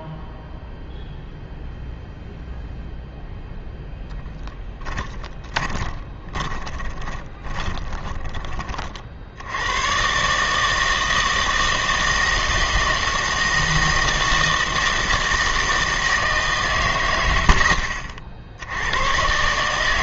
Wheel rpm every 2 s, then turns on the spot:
0, 0, 10, 20, 30, 160, 160, 160, 140, 70.
4-8